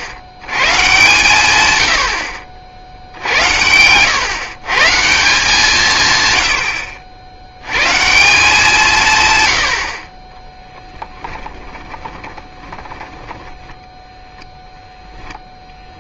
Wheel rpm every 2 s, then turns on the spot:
90, 70, 140, 100, 170, 10, 20, 10.
10-14